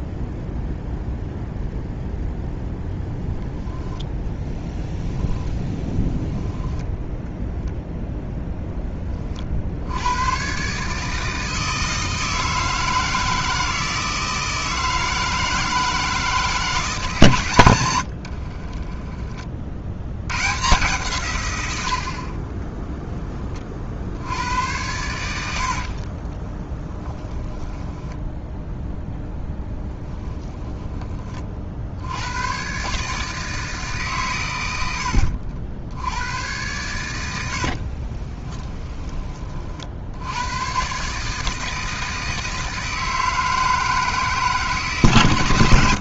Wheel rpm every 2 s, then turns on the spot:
0, 0, 10, 0, 20, 150, 160, 160, 160, 30, 140, 10, 100, 10, 0, 20, 150, 80, 100, 20, 140, 160, 140.
18-20